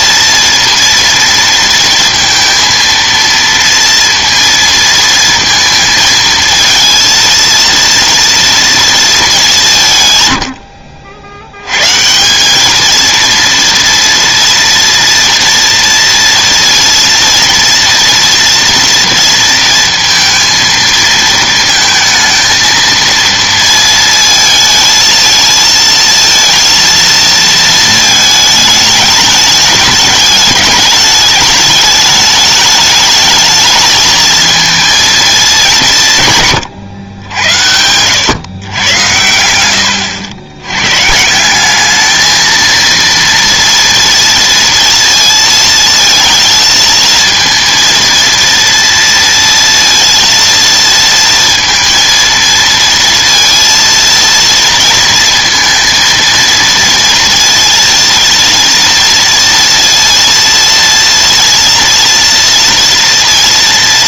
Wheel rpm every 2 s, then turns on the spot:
230, 230, 230, 220, 230, 90, 200, 230, 230, 230, 230, 230, 220, 230, 220, 210, 210, 230, 130, 120, 100, 230, 230, 230, 230, 230, 230, 230, 230, 240, 230, 230.
none